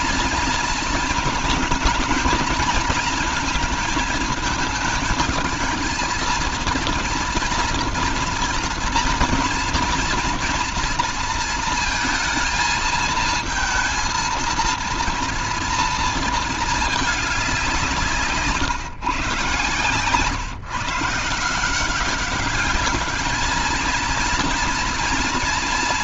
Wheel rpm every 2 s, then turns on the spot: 230, 220, 220, 230, 230, 230, 230, 230, 220, 140, 150, 200, 230.
none